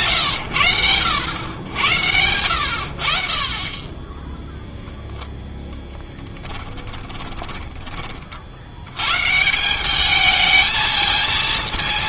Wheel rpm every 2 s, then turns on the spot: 90, 70, 0, 20, 110, 220.
6-8